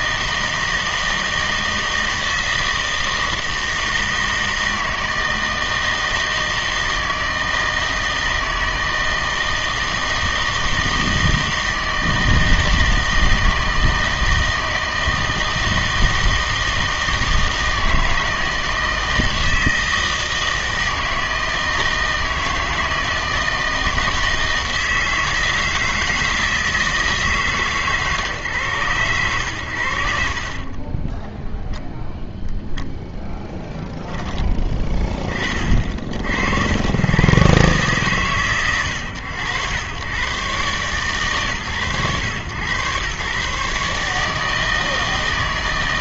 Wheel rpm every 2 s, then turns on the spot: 160, 160, 160, 160, 160, 160, 160, 160, 160, 160, 160, 160, 160, 160, 120, 30, 0, 10, 80, 100, 130, 110, 160.
30-32